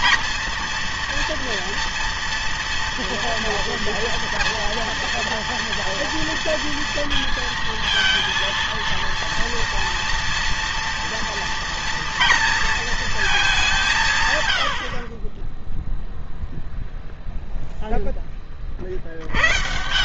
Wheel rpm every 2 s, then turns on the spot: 230, 230, 230, 230, 230, 230, 230, 70, 0, 50.
none